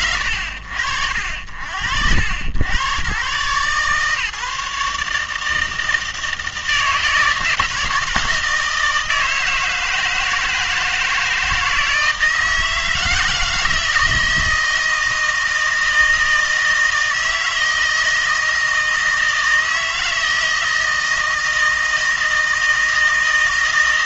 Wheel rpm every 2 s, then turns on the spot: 50, 90, 150, 160, 160, 160, 160, 160, 160, 160, 160, 160.
none